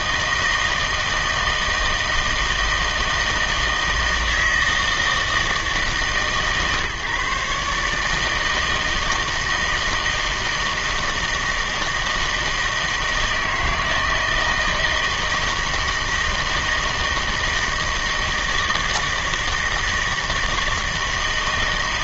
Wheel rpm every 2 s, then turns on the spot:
160, 160, 160, 140, 160, 160, 160, 160, 160, 160, 160.
none